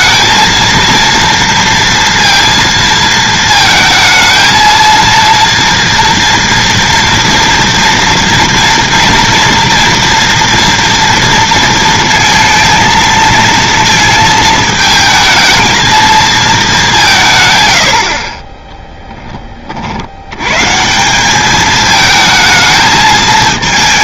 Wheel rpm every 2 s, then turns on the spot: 230, 230, 230, 230, 230, 230, 230, 220, 210, 20, 130, 220.
none